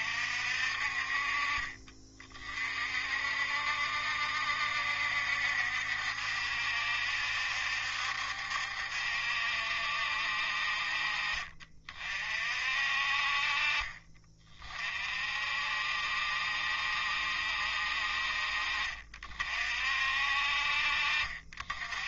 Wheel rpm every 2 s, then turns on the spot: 50, 50, 70, 70, 70, 50, 50, 40, 70, 50, 50.
none